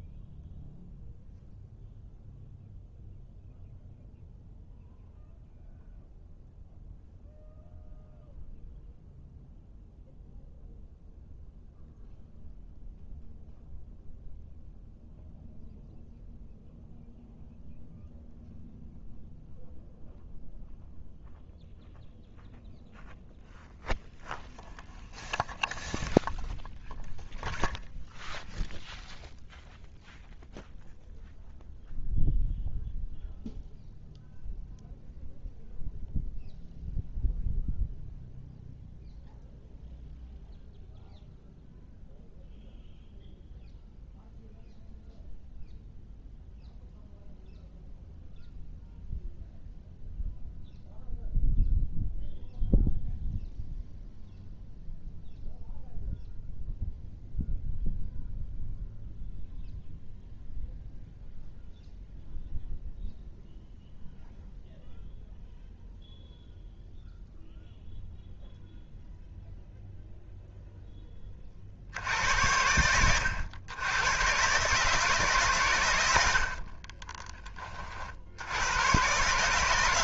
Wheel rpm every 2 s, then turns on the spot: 0, 0, 0, 0, 0, 0, 0, 0, 0, 0, 0, 0, 0, 0, 0, 0, 0, 0, 0, 0, 0, 0, 0, 0, 0, 0, 0, 0, 0, 0, 0, 0, 0, 0, 0, 0, 80, 140, 50, 90.
76-78